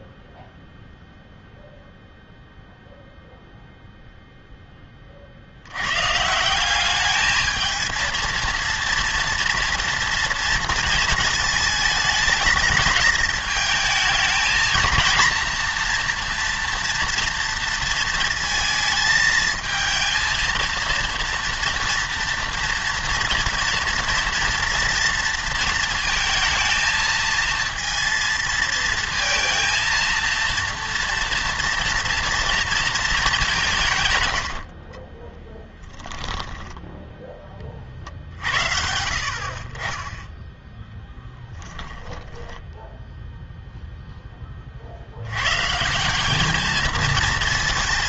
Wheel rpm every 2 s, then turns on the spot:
0, 0, 10, 190, 230, 230, 210, 220, 240, 220, 230, 240, 230, 220, 230, 230, 230, 60, 10, 70, 0, 10, 40, 220.
34-38 42-44